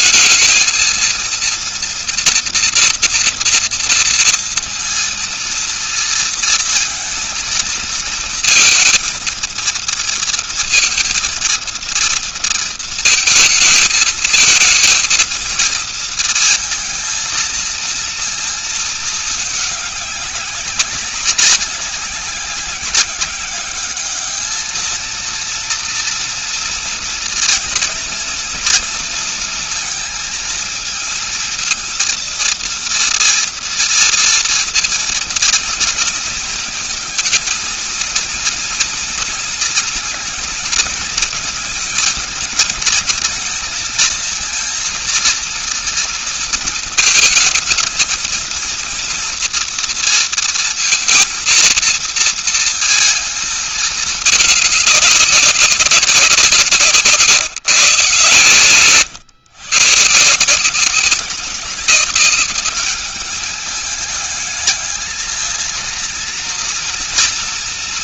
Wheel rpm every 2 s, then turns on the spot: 220, 230, 230, 230, 230, 230, 230, 220, 220, 230, 200, 190, 220, 230, 230, 220, 230, 230, 230, 230, 220, 220, 230, 230, 220, 230, 230, 210, 170, 120, 160, 210, 220, 230.
58-60